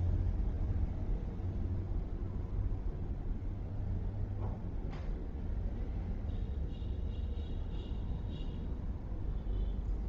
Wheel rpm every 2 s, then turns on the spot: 0, 0, 0, 0, 0.
none